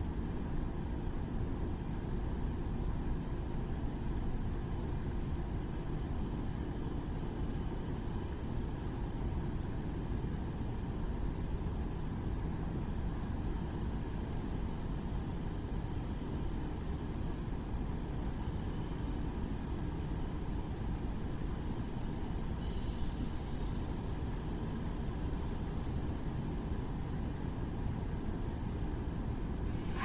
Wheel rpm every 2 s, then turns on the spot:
0, 0, 0, 0, 0, 0, 0, 0, 0, 0, 0, 0, 0, 0, 10.
none